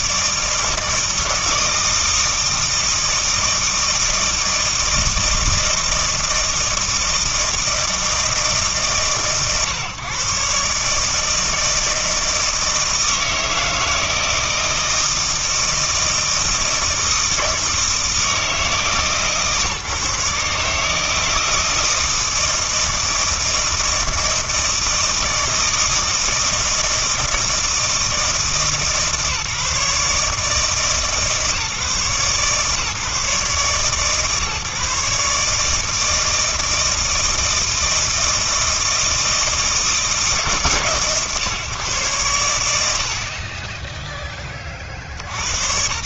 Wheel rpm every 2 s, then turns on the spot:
160, 160, 160, 160, 150, 140, 160, 160, 160, 160, 150, 160, 160, 160, 150, 150, 150, 140, 160, 160, 140, 80, 60.
none